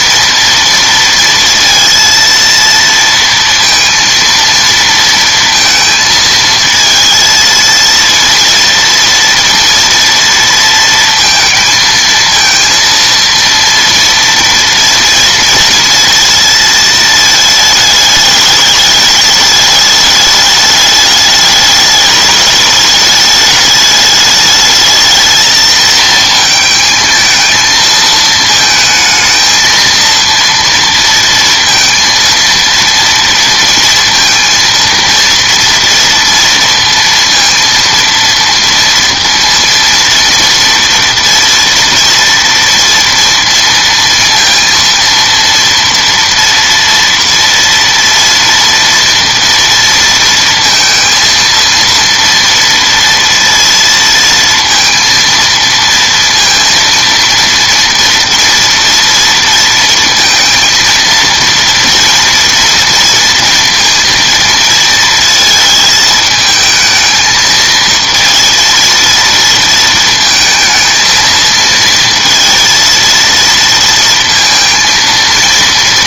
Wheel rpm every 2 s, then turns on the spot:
230, 230, 230, 220, 230, 230, 230, 230, 230, 210, 210, 210, 210, 220, 220, 230, 230, 230, 230, 230, 230, 230, 230, 230, 230, 230, 230, 230, 230, 230, 230, 230, 230, 220, 230, 220, 230, 230.
none